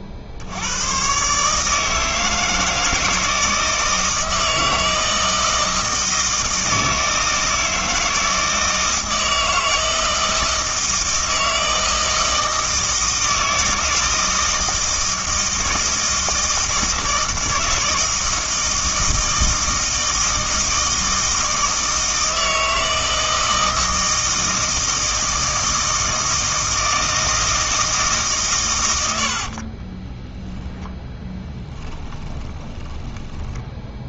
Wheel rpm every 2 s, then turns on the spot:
90, 160, 160, 160, 160, 160, 160, 160, 160, 160, 160, 160, 160, 160, 120, 10, 20.
32-34